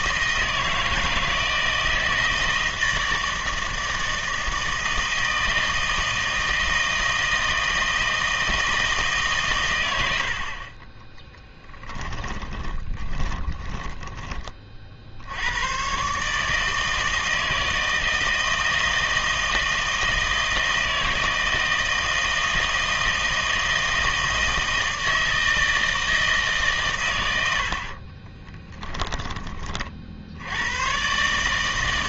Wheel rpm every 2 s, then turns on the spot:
160, 160, 160, 160, 160, 40, 20, 40, 150, 160, 160, 160, 160, 140, 10, 110.
12-14 28-30